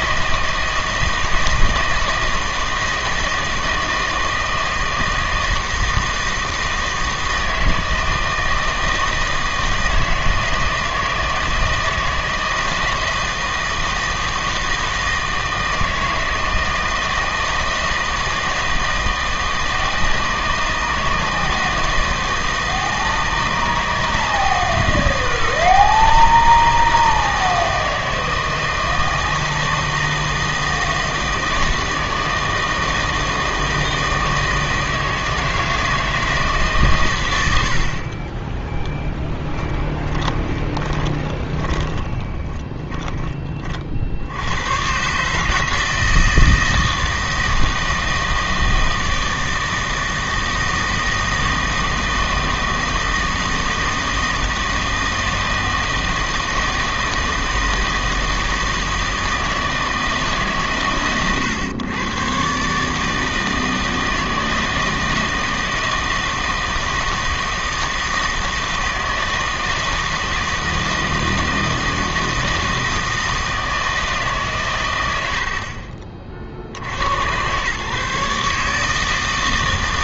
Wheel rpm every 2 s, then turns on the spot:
160, 160, 160, 160, 160, 160, 160, 160, 160, 160, 160, 160, 160, 160, 160, 160, 160, 160, 150, 10, 20, 10, 110, 160, 160, 160, 160, 160, 160, 160, 140, 140, 160, 160, 160, 160, 160, 120, 60, 150.
40-44